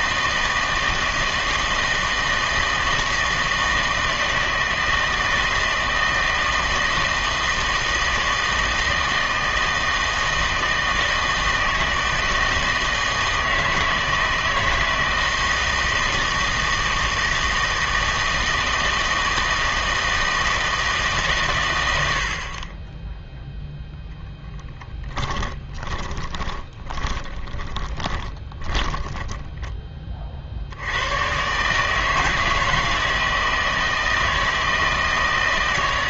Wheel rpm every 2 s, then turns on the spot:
160, 160, 160, 160, 160, 160, 160, 160, 160, 160, 160, 60, 10, 20, 20, 60, 160, 160.
26-30